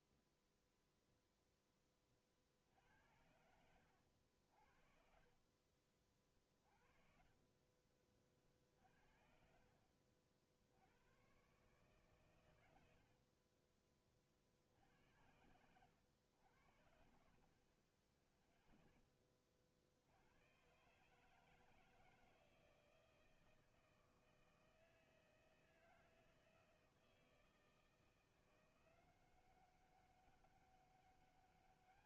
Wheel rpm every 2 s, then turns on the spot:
0, 50, 70, 40, 50, 70, 110, 50, 80, 10, 100, 160, 160, 160, 170, 200.
6-8